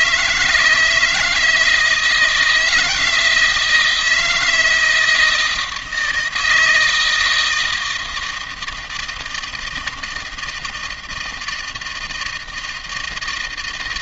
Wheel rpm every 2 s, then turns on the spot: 160, 170, 160, 160, 160, 160, 160.
none